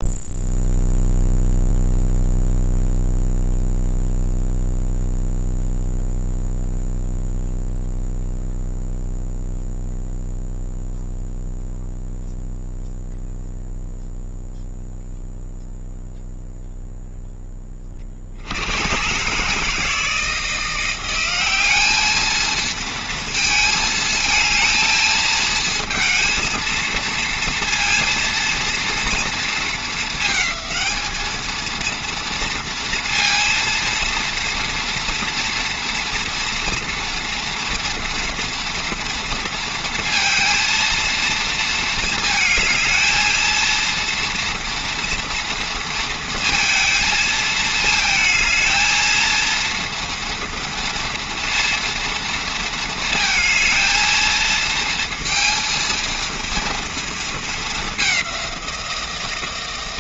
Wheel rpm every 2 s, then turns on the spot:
0, 0, 0, 0, 0, 0, 0, 0, 0, 80, 170, 230, 230, 230, 230, 220, 230, 230, 230, 240, 230, 220, 230, 230, 220, 230, 230, 230, 230, 190.
none